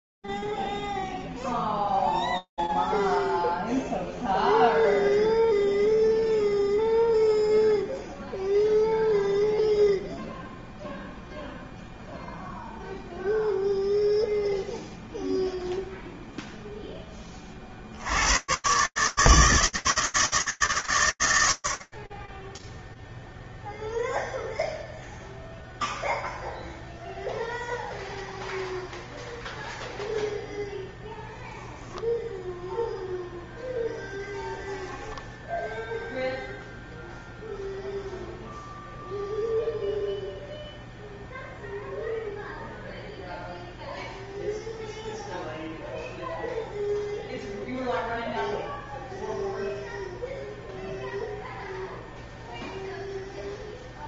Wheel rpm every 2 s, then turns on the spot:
0, 0, 0, 0, 0, 0, 0, 0, 80, 160, 40, 0, 0, 0, 0, 0, 0, 0, 0, 0, 0, 0, 0, 0, 0, 0, 0.
none